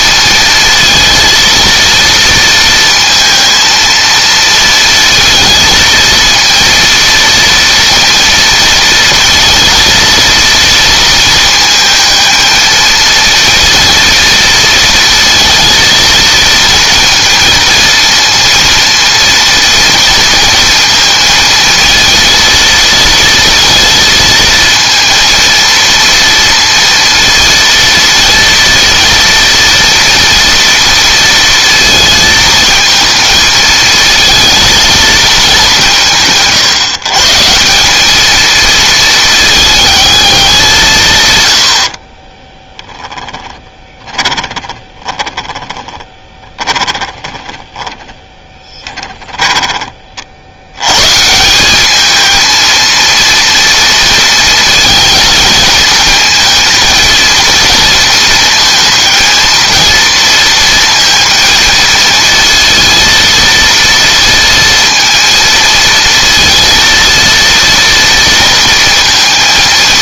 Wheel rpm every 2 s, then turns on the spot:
230, 230, 230, 230, 230, 230, 220, 230, 230, 230, 230, 230, 230, 230, 230, 230, 220, 220, 150, 220, 170, 10, 20, 20, 20, 100, 230, 230, 220, 220, 220, 230, 230, 230, 230.
42-50